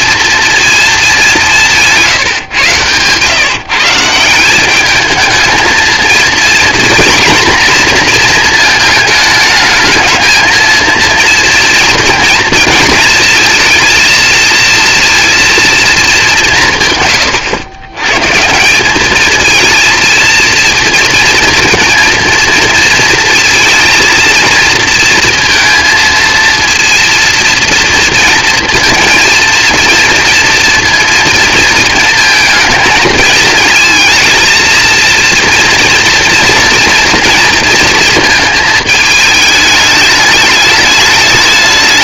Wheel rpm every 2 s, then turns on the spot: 230, 130, 190, 230, 230, 220, 230, 230, 170, 170, 230, 230, 230, 230, 230, 230, 220, 230, 230, 230, 210.
none